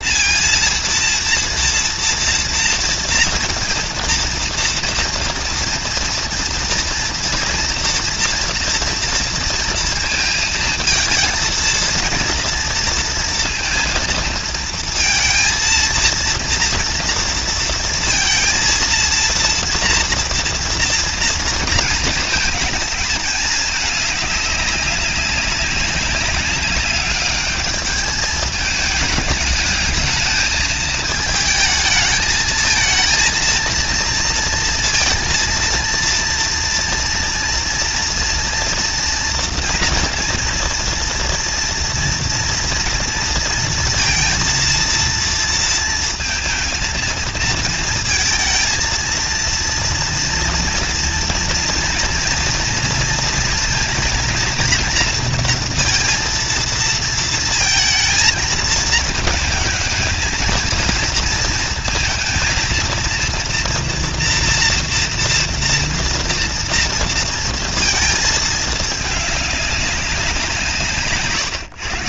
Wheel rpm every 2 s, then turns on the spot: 230, 230, 230, 230, 230, 230, 220, 230, 230, 230, 230, 230, 220, 200, 210, 210, 220, 230, 230, 230, 240, 230, 230, 230, 220, 230, 230, 230, 230, 230, 220, 230, 230, 230, 230, 210.
none